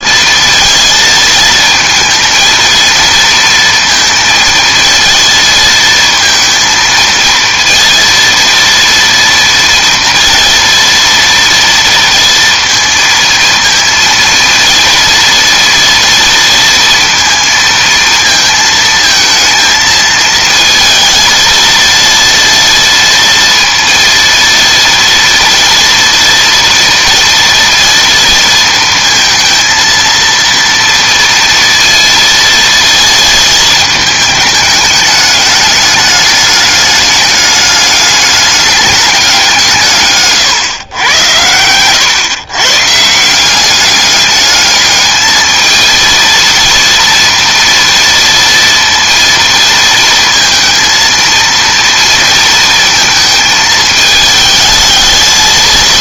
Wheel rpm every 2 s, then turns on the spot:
230, 230, 230, 230, 230, 230, 230, 230, 230, 220, 220, 230, 230, 230, 230, 230, 230, 210, 210, 200, 120, 130, 210, 230, 230, 220, 220, 220.
none